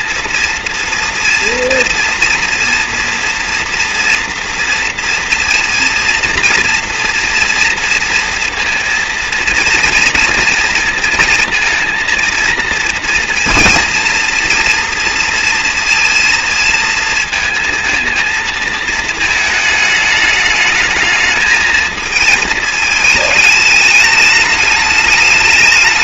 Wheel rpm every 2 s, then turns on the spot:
230, 230, 230, 240, 230, 230, 230, 230, 230, 230, 220, 220, 210.
none